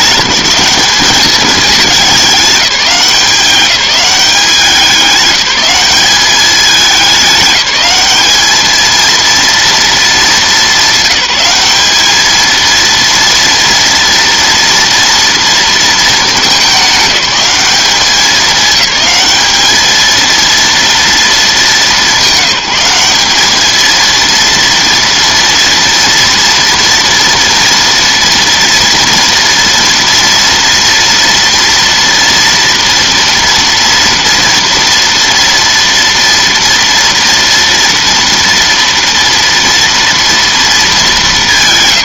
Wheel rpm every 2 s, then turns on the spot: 200, 200, 190, 200, 220, 210, 230, 230, 200, 210, 230, 200, 230, 230, 230, 230, 230, 230, 230, 230, 230.
none